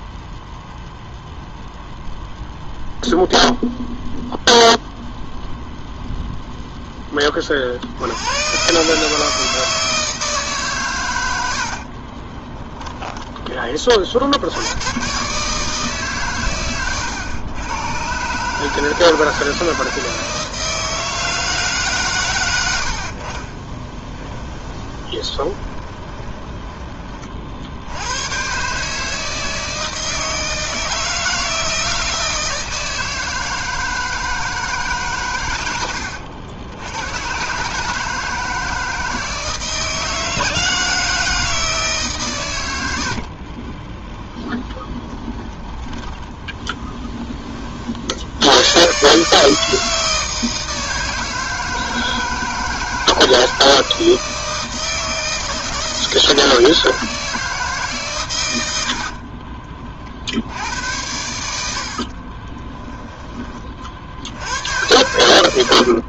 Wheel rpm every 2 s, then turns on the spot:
0, 0, 0, 10, 140, 130, 20, 120, 110, 160, 160, 70, 20, 20, 150, 160, 160, 150, 100, 160, 160, 90, 20, 10, 130, 160, 160, 160, 160, 80, 90, 20, 100.
12-14 24-26 44-46 58-60 62-64